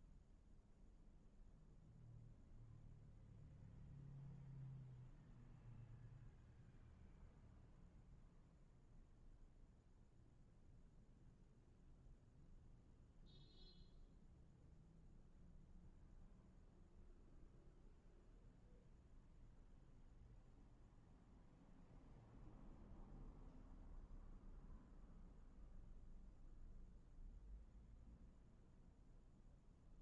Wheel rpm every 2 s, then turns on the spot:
0, 0, 0, 0, 0, 0, 0, 0, 0, 0, 0, 0, 0, 0, 0.
none